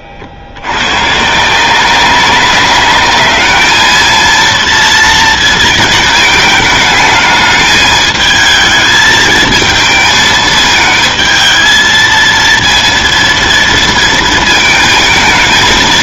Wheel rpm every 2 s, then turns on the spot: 90, 200, 230, 210, 220, 220, 230, 220.
none